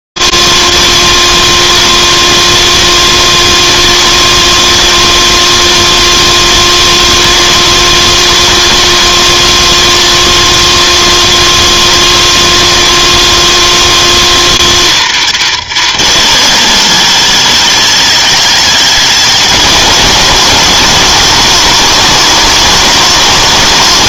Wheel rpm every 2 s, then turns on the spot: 120, 120, 120, 120, 120, 120, 120, 120, 130, 190, 150, 120.
none